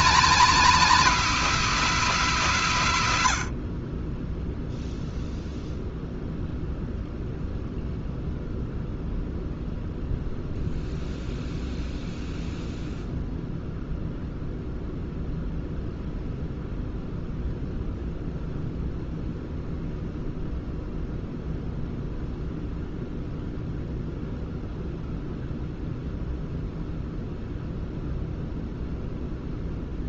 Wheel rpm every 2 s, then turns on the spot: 240, 150, 0, 0, 0, 0, 0, 0, 0, 0, 0, 0, 0, 0, 0.
none